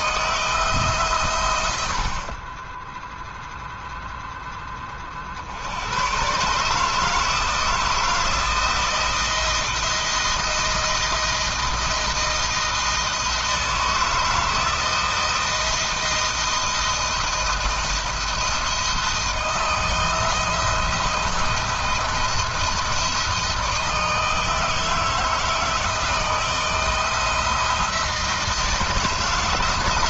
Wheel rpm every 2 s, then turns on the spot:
140, 10, 40, 150, 160, 170, 160, 160, 160, 160, 170, 160, 160, 170, 160.
none